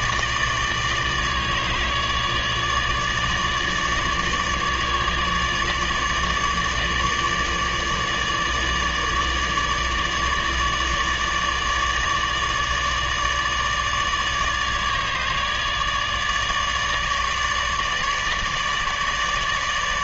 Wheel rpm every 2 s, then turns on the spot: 150, 150, 150, 150, 150, 150, 150, 150, 150, 150.
none